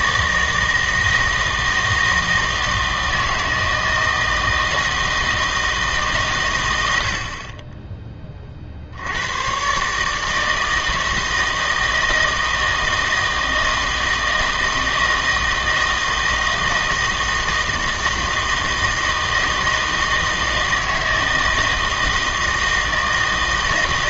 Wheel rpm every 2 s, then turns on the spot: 160, 160, 160, 110, 60, 160, 160, 160, 160, 160, 160, 160.
none